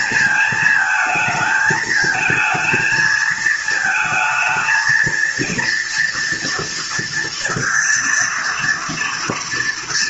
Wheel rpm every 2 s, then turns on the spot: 220, 220, 220, 230, 230.
none